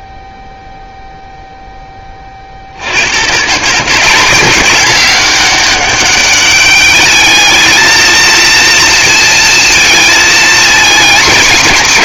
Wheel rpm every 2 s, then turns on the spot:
0, 20, 180, 200, 220, 230.
none